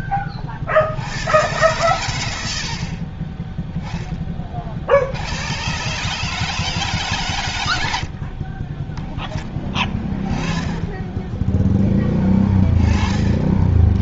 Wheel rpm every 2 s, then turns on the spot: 20, 50, 30, 160, 10, 10, 20.
none